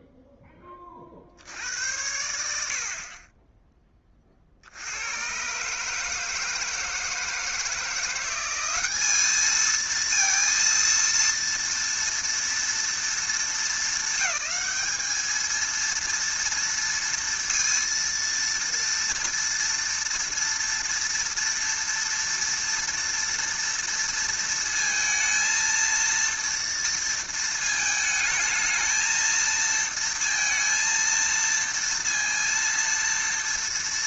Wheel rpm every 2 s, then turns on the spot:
20, 70, 70, 160, 190, 230, 230, 220, 230, 230, 230, 230, 230, 230, 220, 230, 230.
none